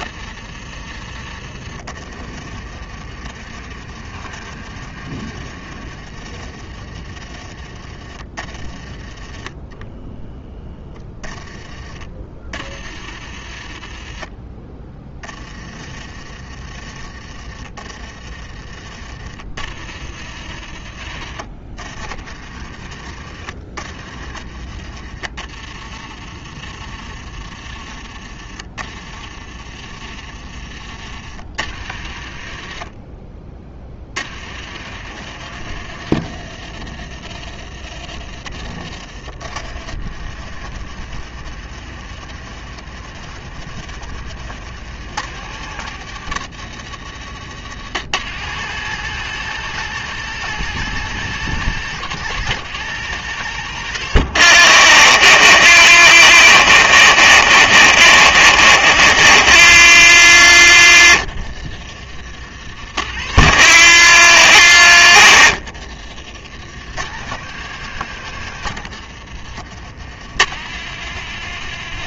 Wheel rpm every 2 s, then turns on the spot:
30, 40, 40, 30, 20, 10, 40, 20, 30, 30, 50, 40, 40, 30, 30, 30, 30, 60, 50, 40, 70, 70, 90, 90, 120, 130, 130, 70, 60, 60, 70, 60, 60, 70, 80, 110.
2-6 18-20 22-24 38-40